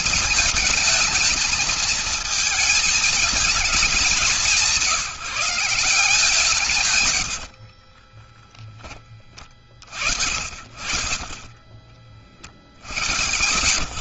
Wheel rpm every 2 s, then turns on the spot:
220, 220, 180, 150, 10, 50, 50.
8-10 12-14